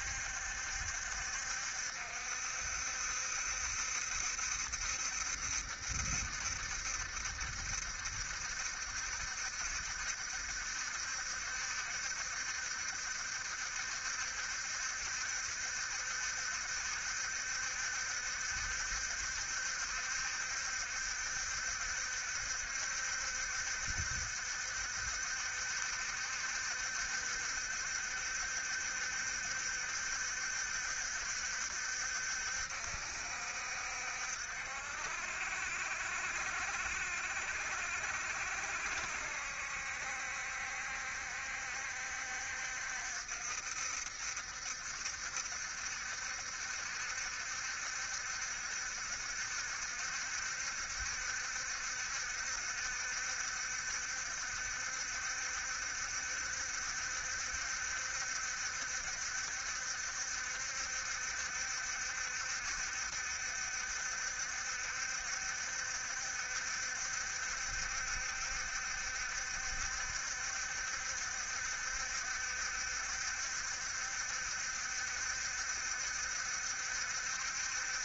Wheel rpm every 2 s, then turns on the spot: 70, 70, 60, 70, 70, 70, 70, 70, 70, 70, 70, 70, 70, 70, 70, 70, 60, 60, 60, 70, 70, 60, 70, 70, 70, 70, 70, 70, 70, 70, 70, 70, 70, 70, 70, 70, 70, 70, 70.
none